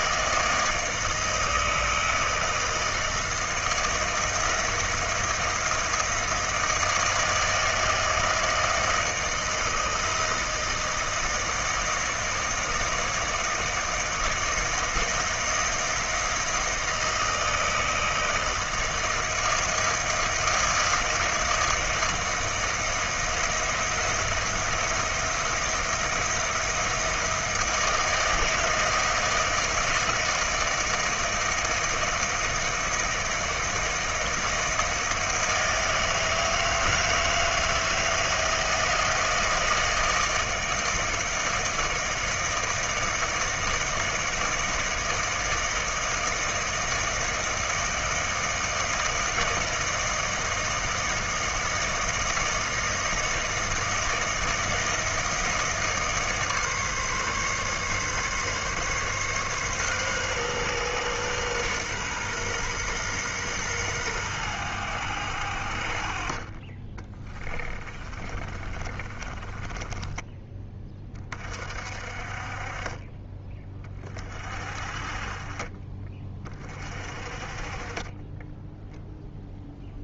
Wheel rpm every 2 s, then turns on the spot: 160, 160, 170, 160, 160, 160, 160, 160, 160, 160, 160, 160, 170, 170, 160, 170, 160, 160, 160, 160, 160, 160, 160, 160, 160, 160, 160, 160, 150, 140, 130, 120, 100, 40, 40, 20, 40, 40, 20, 10.
68-70